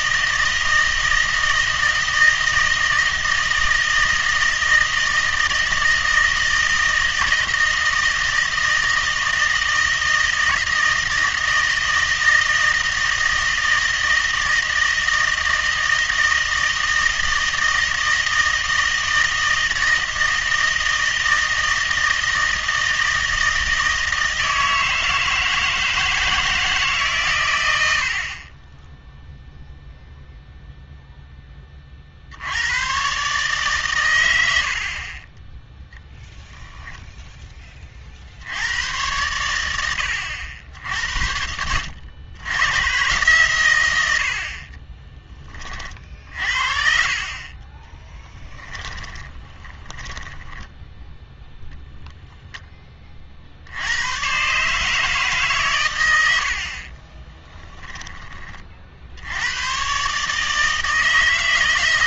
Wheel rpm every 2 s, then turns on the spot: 160, 160, 160, 160, 160, 160, 160, 160, 160, 160, 160, 160, 160, 160, 20, 0, 100, 80, 0, 90, 80, 110, 50, 50, 10, 10, 10, 140, 60, 40, 160.
48-52